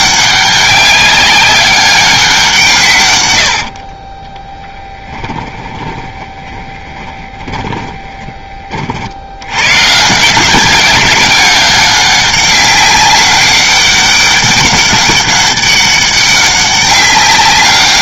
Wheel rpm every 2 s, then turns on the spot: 200, 130, 10, 20, 40, 190, 200, 200, 190.
4-8